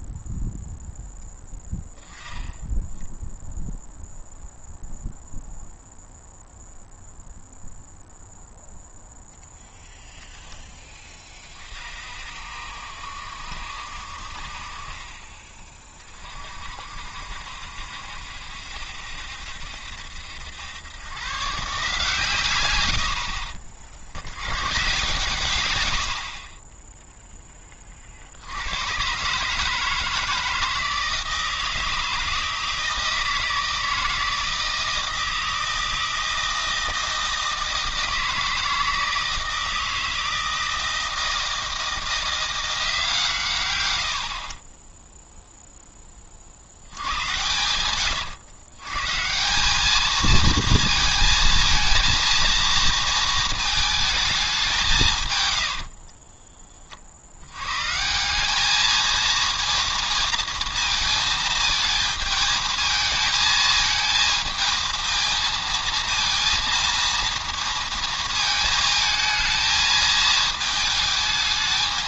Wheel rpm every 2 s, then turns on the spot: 0, 10, 0, 0, 0, 10, 60, 40, 50, 70, 100, 100, 130, 20, 100, 160, 160, 160, 160, 160, 160, 170, 20, 70, 140, 230, 230, 170, 50, 220, 230, 220, 220, 230, 220, 220.
none